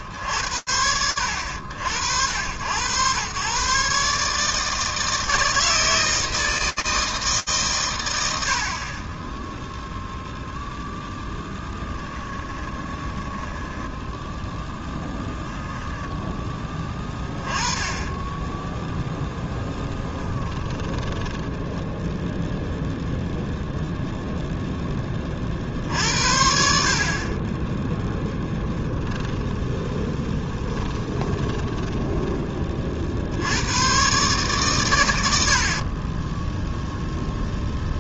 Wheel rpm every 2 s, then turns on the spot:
80, 150, 160, 70, 0, 20, 0, 10, 10, 10, 0, 0, 60, 10, 10, 20, 130, 20, 0.
10-12 18-20 24-30